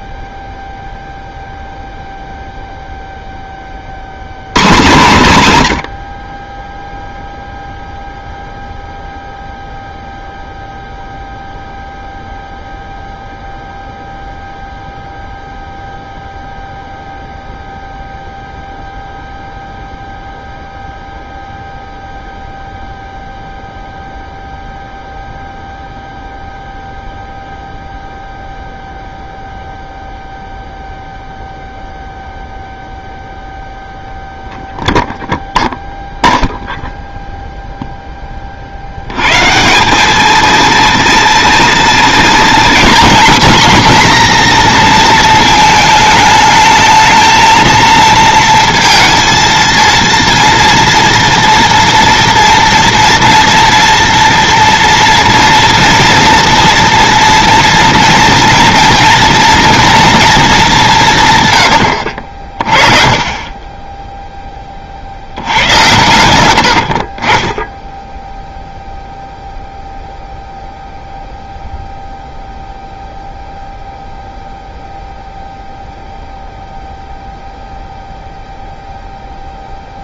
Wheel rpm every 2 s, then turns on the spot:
0, 0, 130, 0, 0, 0, 0, 0, 0, 0, 0, 0, 0, 0, 0, 0, 0, 0, 0, 60, 230, 230, 240, 220, 230, 230, 230, 230, 230, 230, 180, 30, 30, 60, 0, 0, 0, 0, 0, 0.
66-68